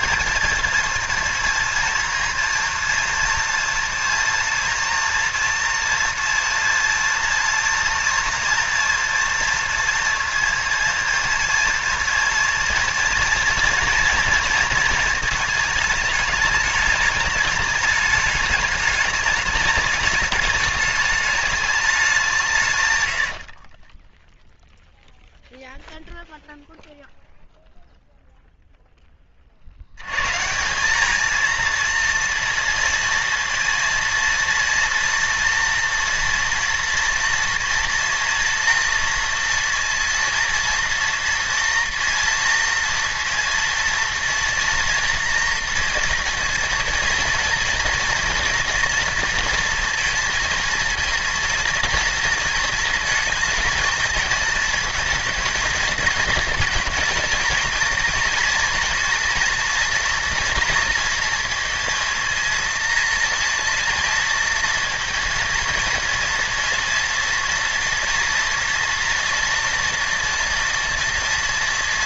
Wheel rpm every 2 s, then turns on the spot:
230, 230, 240, 230, 230, 230, 230, 230, 210, 210, 210, 140, 0, 0, 0, 170, 230, 230, 230, 230, 230, 230, 240, 230, 230, 230, 230, 220, 230, 230, 230, 230, 230, 230, 230, 230.
none